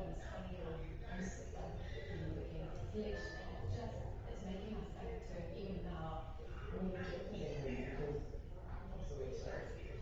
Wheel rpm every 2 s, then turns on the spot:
0, 0, 0, 0, 0.
none